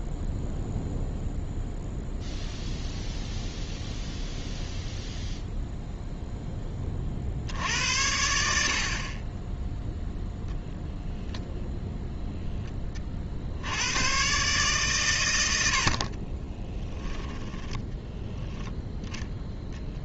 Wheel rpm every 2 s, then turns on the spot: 0, 0, 0, 20, 60, 0, 10, 140, 20, 0.
16-18